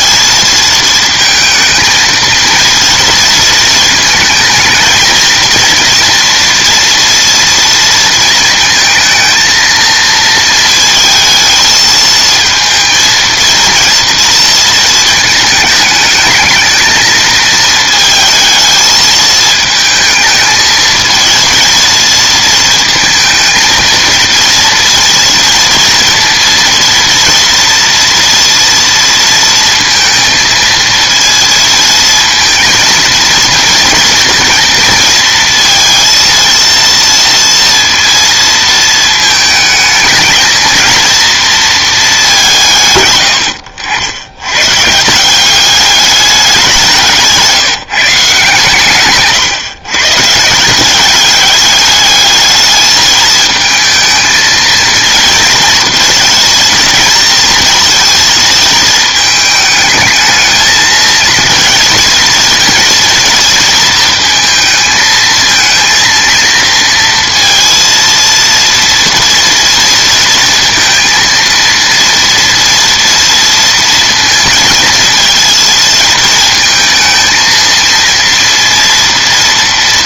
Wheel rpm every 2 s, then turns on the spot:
230, 230, 220, 230, 230, 220, 230, 220, 220, 220, 220, 230, 230, 230, 230, 230, 230, 230, 230, 220, 220, 150, 120, 190, 140, 170, 220, 220, 230, 220, 220, 230, 220, 230, 230, 230, 230, 230, 220, 230.
none